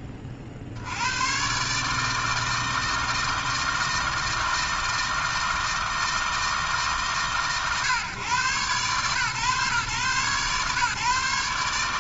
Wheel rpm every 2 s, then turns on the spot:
70, 160, 160, 150, 130, 140.
none